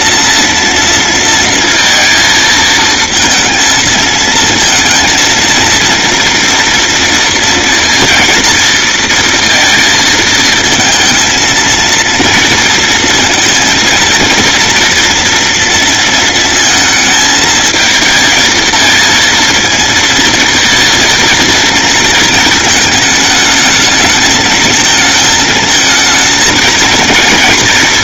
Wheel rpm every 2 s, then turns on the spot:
230, 220, 230, 240, 230, 230, 230, 230, 220, 220, 230, 220, 220, 220.
none